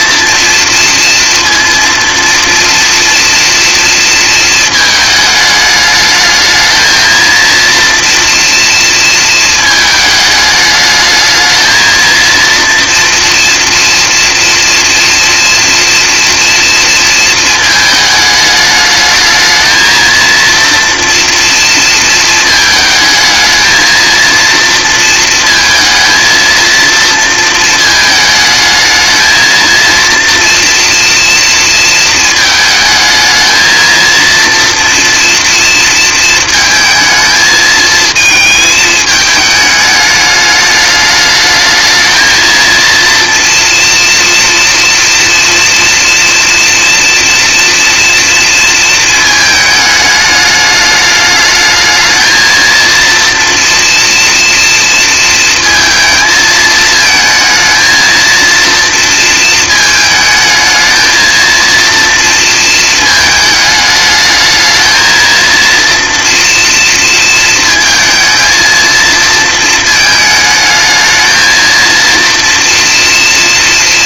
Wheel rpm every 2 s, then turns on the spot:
230, 230, 210, 230, 220, 220, 240, 230, 220, 220, 230, 220, 230, 230, 230, 230, 220, 230, 220, 210, 220, 240, 230, 230, 220, 220, 230, 230, 220, 220, 230, 220, 230, 230, 220, 230, 230.
none